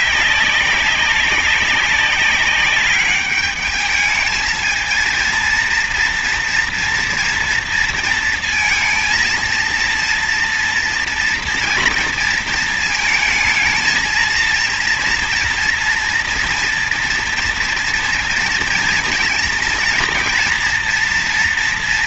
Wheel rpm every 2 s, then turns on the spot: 190, 200, 220, 230, 230, 230, 230, 230, 240, 230, 230.
none